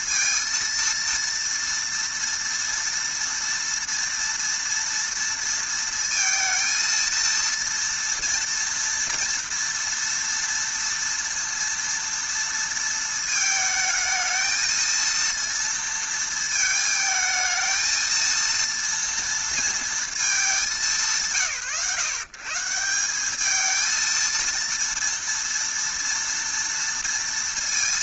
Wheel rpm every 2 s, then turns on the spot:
230, 230, 230, 230, 240, 230, 230, 230, 220, 230, 200, 170, 230, 230.
none